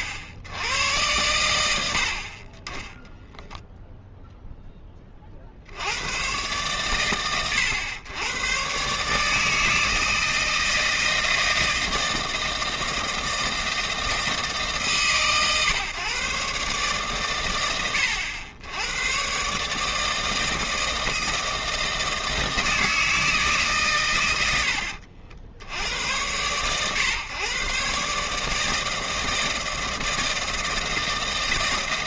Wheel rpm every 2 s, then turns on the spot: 70, 40, 10, 120, 120, 160, 160, 140, 140, 100, 160, 160, 90, 110, 150, 160.
none